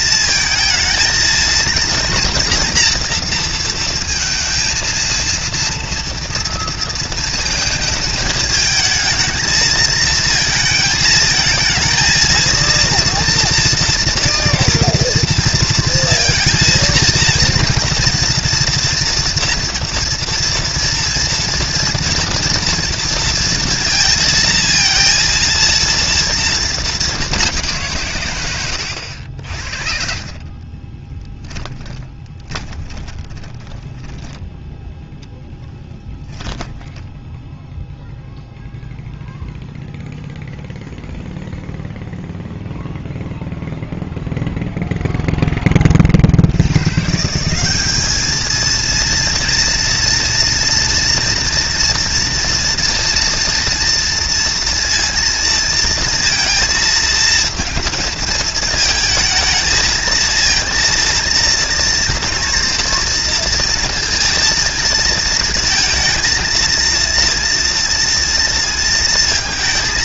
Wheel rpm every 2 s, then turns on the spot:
230, 230, 230, 230, 220, 230, 230, 240, 230, 230, 230, 230, 230, 210, 100, 40, 20, 0, 10, 0, 0, 0, 0, 110, 230, 240, 230, 230, 230, 220, 230, 230, 230, 230, 230.
28-34 36-38